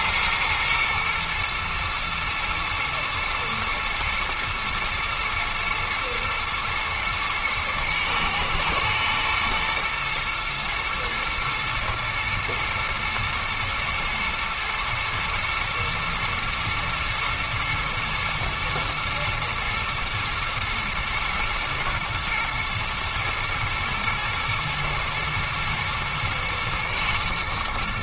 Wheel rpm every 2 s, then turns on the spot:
120, 110, 110, 110, 110, 120, 110, 110, 120, 120, 120, 110, 120, 120.
none